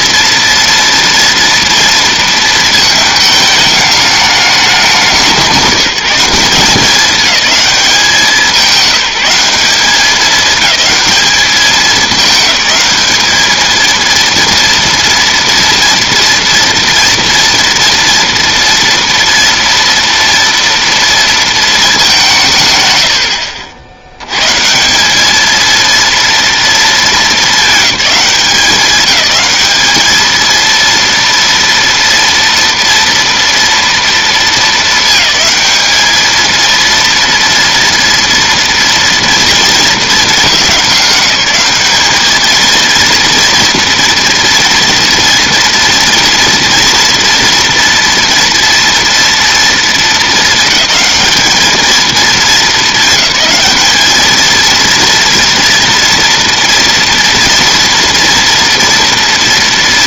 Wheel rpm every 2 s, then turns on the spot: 230, 230, 210, 190, 190, 210, 210, 230, 230, 230, 230, 200, 100, 230, 190, 220, 230, 220, 220, 230, 200, 220, 240, 230, 230, 220, 220, 220, 230, 240.
none